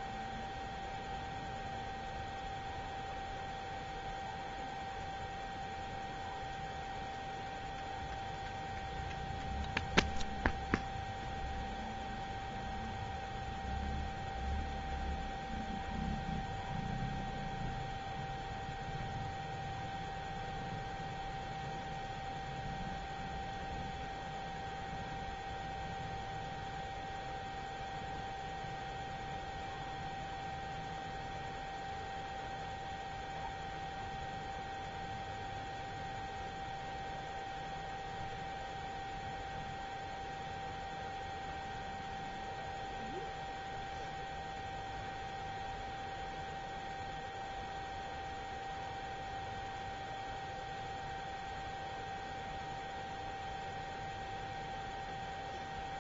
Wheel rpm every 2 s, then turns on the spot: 0, 0, 0, 0, 0, 0, 0, 0, 0, 0, 0, 0, 0, 0, 0, 0, 0, 0, 0, 0, 0, 0, 0, 0, 0, 0, 0, 0.
none